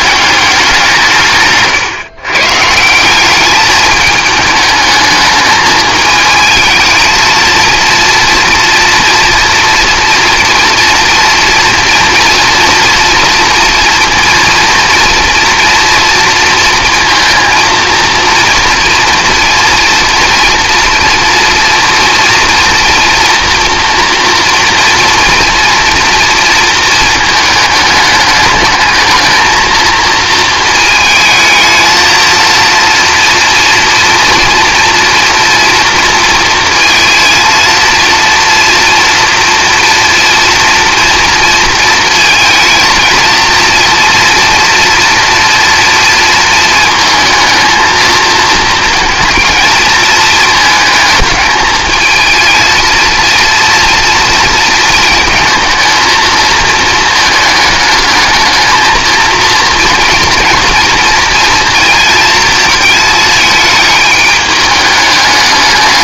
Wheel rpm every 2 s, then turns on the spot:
170, 160, 220, 220, 230, 230, 230, 230, 230, 230, 230, 240, 230, 220, 210, 220, 230, 230, 230, 230, 230, 230, 240, 220, 230, 220, 230, 230, 220, 220, 230, 220, 210.
none